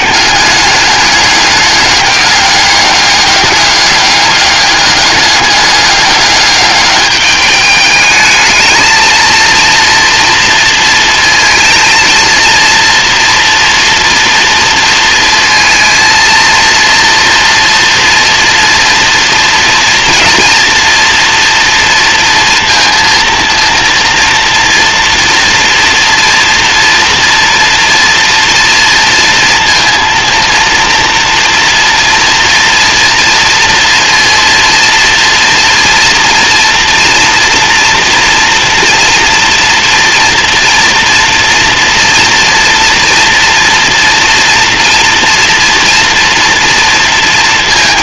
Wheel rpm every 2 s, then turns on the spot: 200, 200, 200, 210, 220, 230, 230, 230, 230, 230, 230, 230, 230, 230, 230, 230, 230, 240, 230, 230, 240, 240, 230, 230.
none